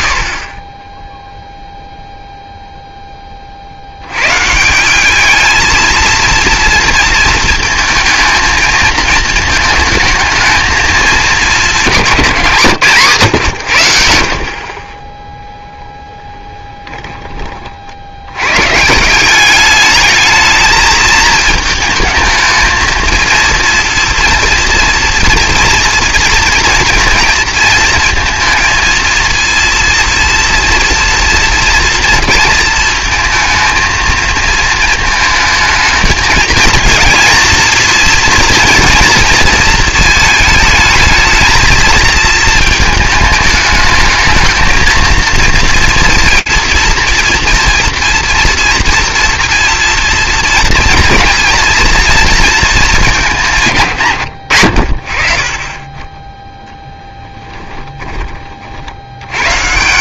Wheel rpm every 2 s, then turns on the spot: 40, 0, 160, 230, 220, 220, 160, 30, 10, 160, 220, 220, 230, 240, 230, 240, 230, 230, 230, 240, 220, 220, 230, 230, 240, 220, 200, 50, 0, 40.
none